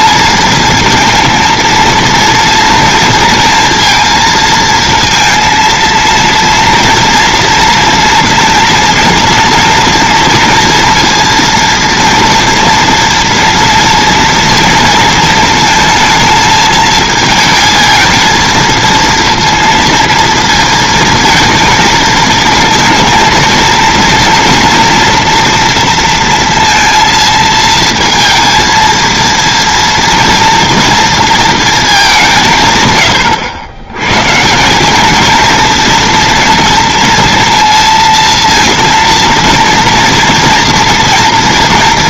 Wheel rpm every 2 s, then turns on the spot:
230, 230, 230, 240, 230, 230, 230, 230, 220, 220, 230, 230, 230, 230, 230, 230, 160, 180, 230, 230, 230.
none